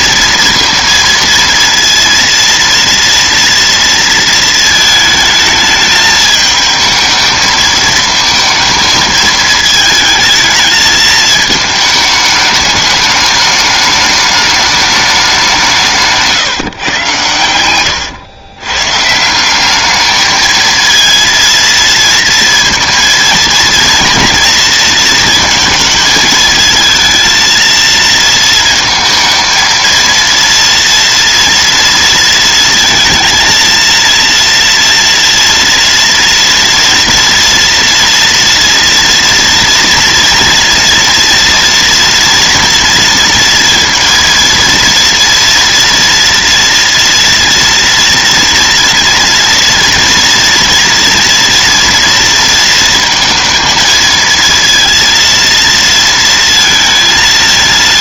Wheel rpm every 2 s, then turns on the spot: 230, 230, 220, 220, 220, 220, 210, 210, 130, 130, 230, 230, 230, 220, 220, 230, 230, 230, 230, 230, 230, 230, 230, 230, 230, 230, 230, 230, 230.
none